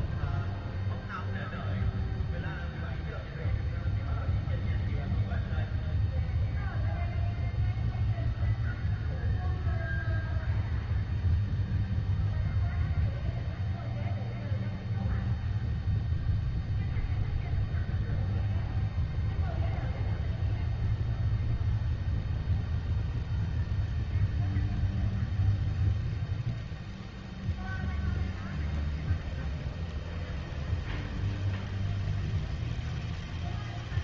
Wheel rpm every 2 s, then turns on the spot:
0, 0, 0, 0, 0, 0, 0, 0, 0, 0, 0, 0, 0, 0, 0, 0, 0.
none